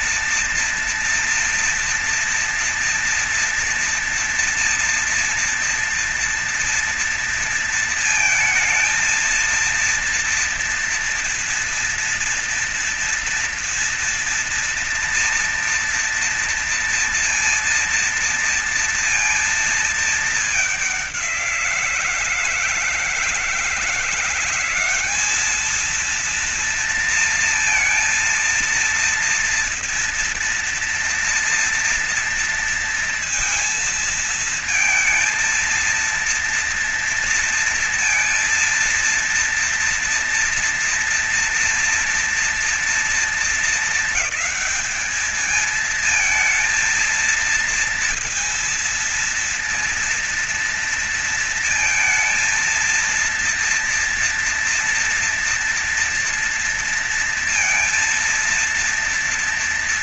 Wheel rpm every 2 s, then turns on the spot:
230, 240, 230, 230, 230, 230, 230, 230, 240, 230, 200, 160, 190, 230, 230, 230, 230, 220, 230, 230, 230, 230, 220, 230, 230, 230, 230, 240, 230, 230.
none